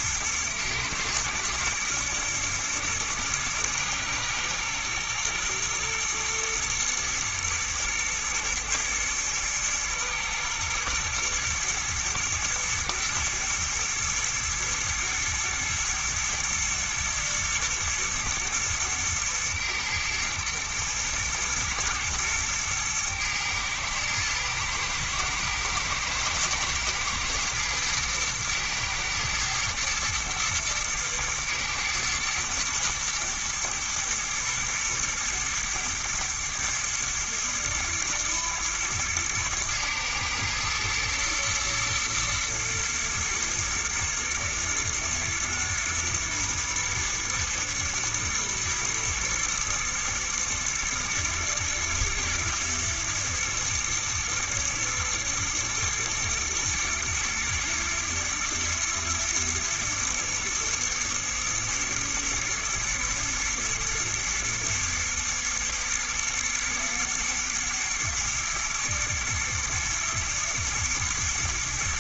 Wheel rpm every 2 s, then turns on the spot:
120, 120, 110, 110, 120, 110, 110, 120, 110, 110, 110, 110, 110, 120, 120, 110, 120, 120, 110, 110, 110, 120, 120, 120, 110, 110, 120, 120, 110, 110, 120, 110, 110, 110, 110, 110.
none